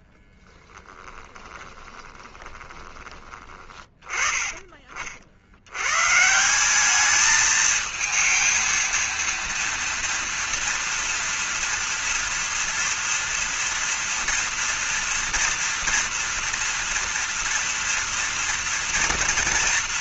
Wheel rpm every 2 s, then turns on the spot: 10, 20, 30, 190, 230, 230, 230, 230, 230, 230.
0-4